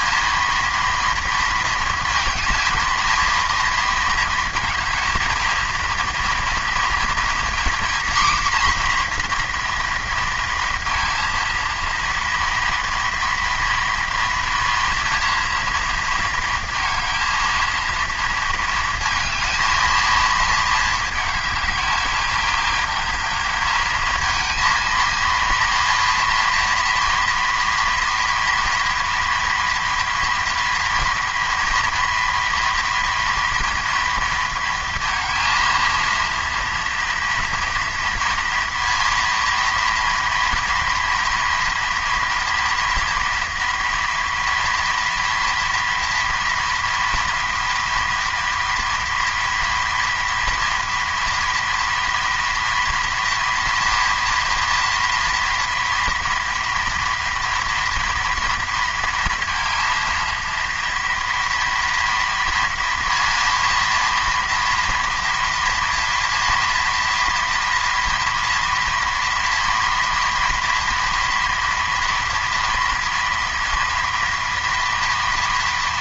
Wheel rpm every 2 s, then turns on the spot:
230, 220, 220, 230, 250, 230, 230, 230, 220, 230, 220, 210, 220, 230, 230, 230, 230, 230, 230, 240, 230, 230, 230, 230, 230, 230, 230, 230, 230, 230, 230, 230, 230, 240, 230, 230, 230, 240.
none